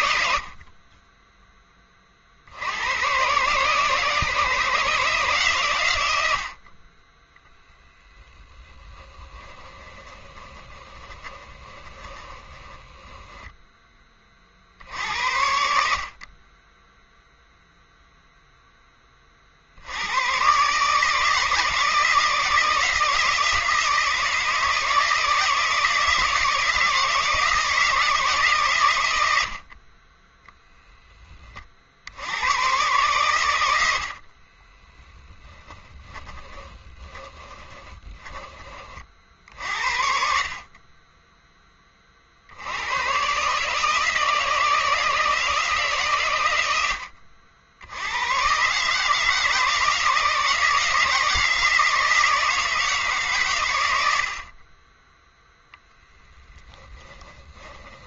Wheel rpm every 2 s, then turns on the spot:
50, 80, 160, 50, 10, 20, 10, 70, 20, 10, 140, 160, 160, 160, 140, 0, 110, 10, 20, 30, 30, 80, 160, 100, 140, 160, 160, 20, 10.
10-14 34-38 56-58